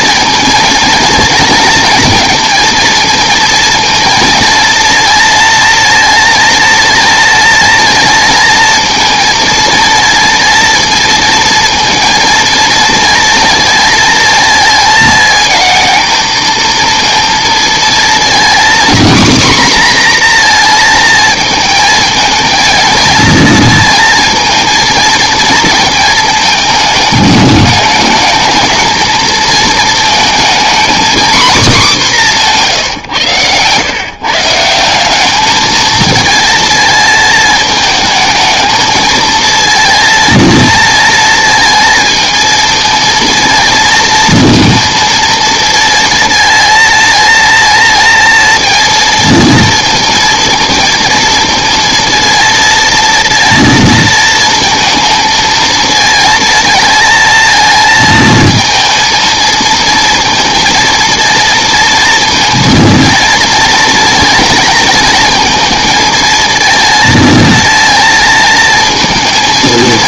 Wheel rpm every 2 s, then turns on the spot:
230, 230, 230, 230, 230, 230, 230, 220, 220, 230, 240, 220, 230, 220, 220, 230, 210, 160, 230, 220, 230, 230, 230, 230, 230, 230, 230, 230, 230, 220, 230, 230, 230, 230, 230.
none